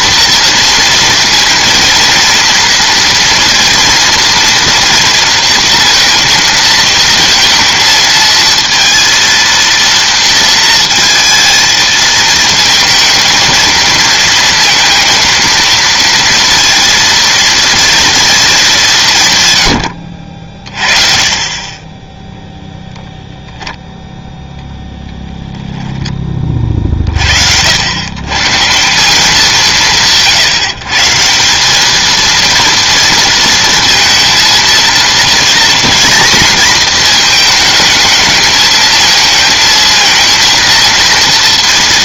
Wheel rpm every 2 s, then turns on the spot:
230, 230, 230, 230, 230, 230, 220, 230, 230, 190, 40, 0, 0, 30, 150, 150, 230, 230, 240, 220, 230.
none